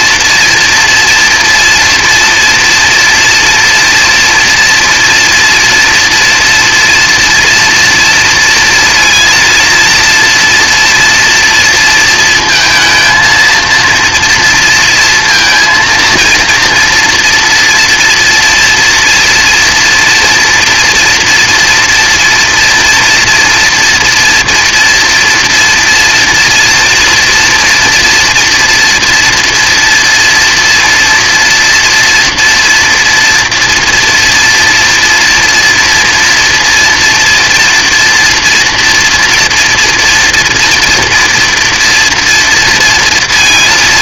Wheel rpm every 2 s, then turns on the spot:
240, 230, 230, 240, 230, 230, 230, 230, 230, 230, 240, 240, 240, 230, 240, 230, 230, 230, 240, 230, 230, 230.
none